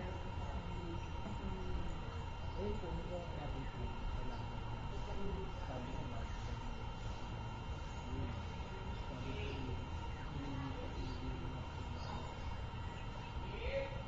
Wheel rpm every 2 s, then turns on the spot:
0, 0, 0, 0, 0, 0, 0.
none